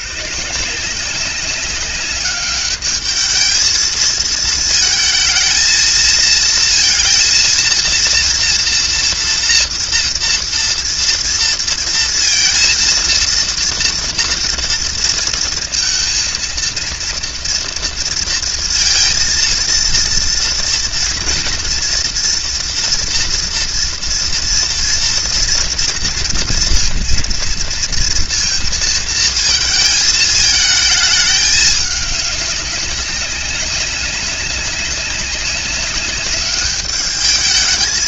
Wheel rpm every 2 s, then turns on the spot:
180, 210, 230, 230, 230, 230, 230, 230, 230, 230, 230, 230, 230, 230, 230, 220, 200, 190, 200.
none